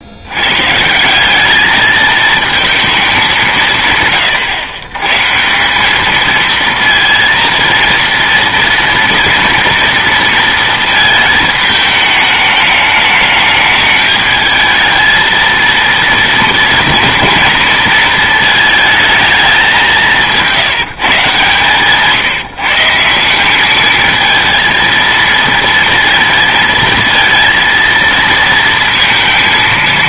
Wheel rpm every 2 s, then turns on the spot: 130, 220, 130, 230, 230, 230, 210, 220, 230, 220, 150, 160, 230, 230, 230.
none